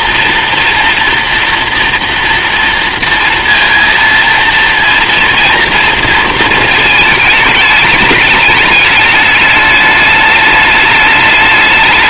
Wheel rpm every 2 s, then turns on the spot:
240, 230, 230, 220, 210, 210.
none